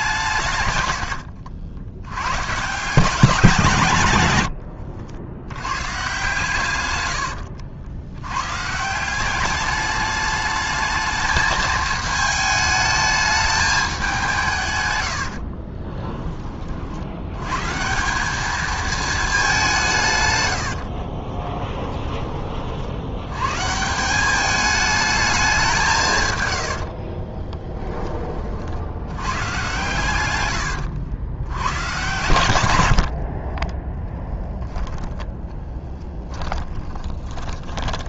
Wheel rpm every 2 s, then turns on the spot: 130, 140, 90, 130, 140, 210, 220, 140, 40, 210, 90, 40, 210, 100, 50, 100, 90, 10, 10.
4-6 20-22 26-28 36-38